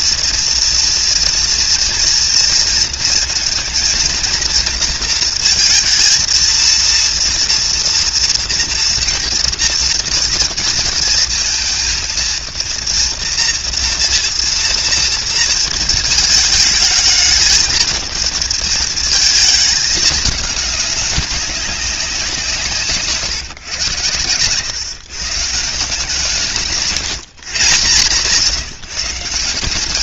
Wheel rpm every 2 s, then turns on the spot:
230, 230, 230, 230, 230, 230, 230, 230, 220, 220, 210, 160, 130, 160, 150.
none